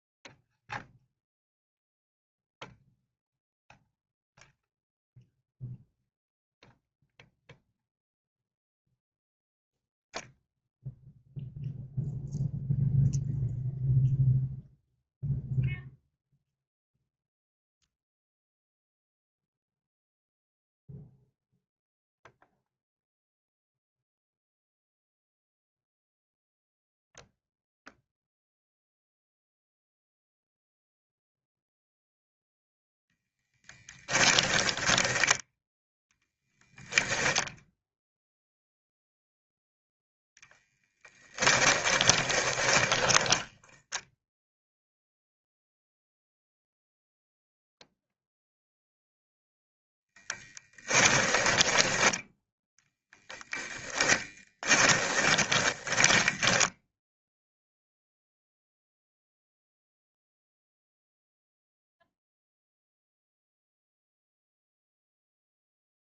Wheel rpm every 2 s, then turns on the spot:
0, 0, 0, 0, 0, 0, 0, 0, 0, 0, 0, 0, 0, 0, 0, 0, 0, 10, 0, 0, 0, 10, 0, 0, 0, 10, 20, 20, 10, 0, 0, 0, 0.
34-36 42-44 50-58